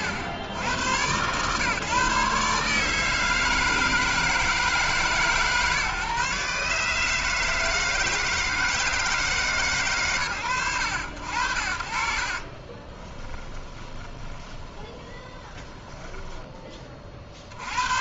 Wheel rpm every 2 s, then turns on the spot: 90, 150, 160, 150, 160, 80, 20, 10, 20.
12-16